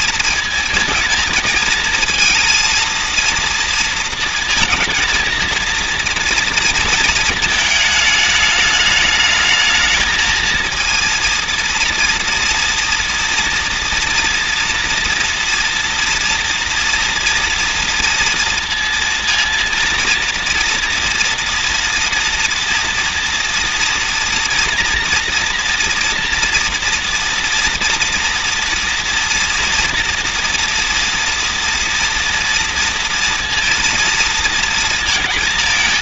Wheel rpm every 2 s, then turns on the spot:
220, 220, 230, 230, 210, 220, 230, 230, 230, 230, 230, 240, 240, 230, 230, 230, 230, 230.
none